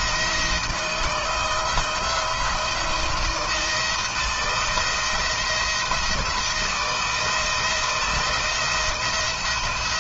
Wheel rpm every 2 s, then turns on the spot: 160, 170, 170, 160, 170.
none